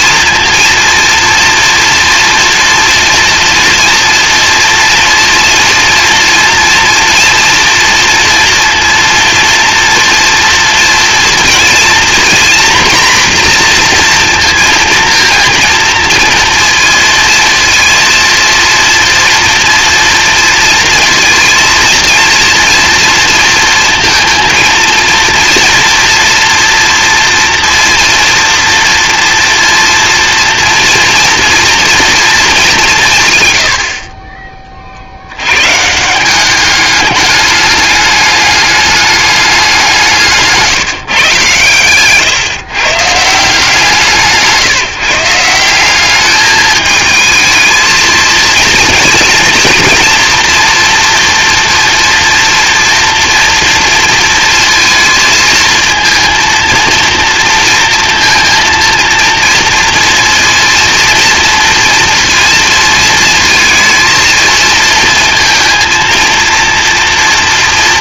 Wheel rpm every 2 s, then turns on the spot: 230, 230, 230, 230, 230, 230, 240, 230, 230, 230, 230, 230, 230, 230, 240, 230, 210, 30, 190, 210, 160, 130, 160, 210, 230, 230, 230, 230, 230, 230, 230, 230, 230, 230.
none